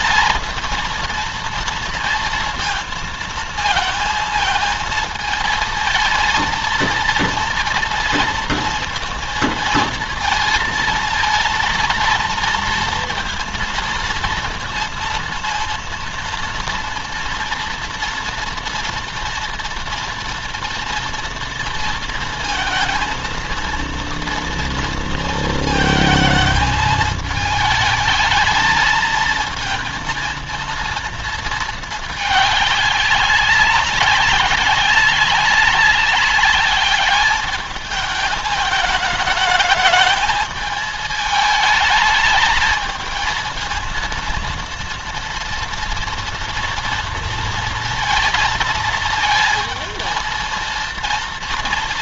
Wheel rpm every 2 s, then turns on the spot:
230, 230, 220, 230, 230, 230, 230, 230, 230, 230, 230, 230, 230, 220, 220, 230, 210, 190, 200, 210, 220, 220, 230, 230, 230, 230.
none